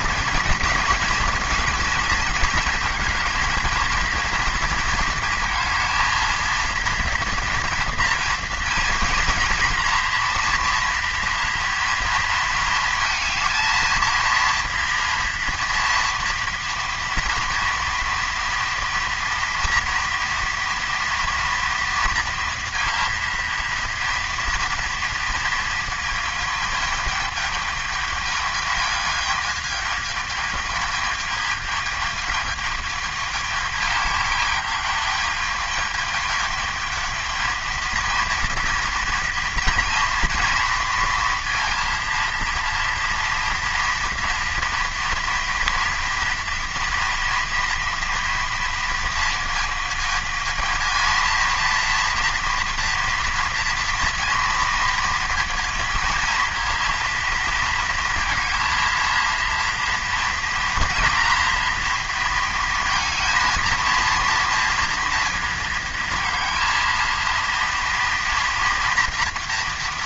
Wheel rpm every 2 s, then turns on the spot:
230, 220, 230, 240, 230, 230, 220, 230, 230, 230, 230, 230, 230, 210, 220, 220, 210, 210, 220, 230, 230, 230, 230, 240, 230, 230, 230, 230, 230, 230, 230, 230, 230, 230, 230.
none